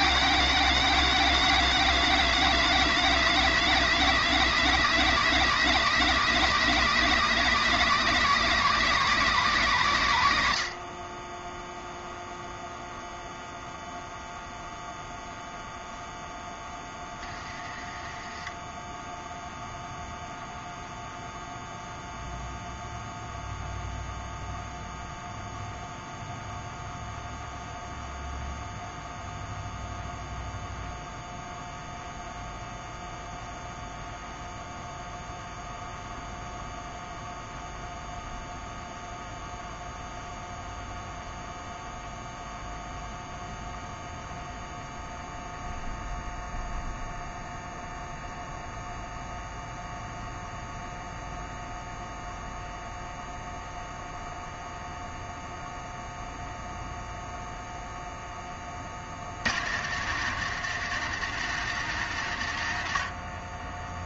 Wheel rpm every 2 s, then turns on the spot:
230, 230, 220, 220, 210, 40, 0, 0, 10, 10, 0, 0, 0, 0, 0, 0, 0, 0, 0, 0, 0, 0, 0, 0, 0, 0, 0, 0, 0, 50, 160, 70.
none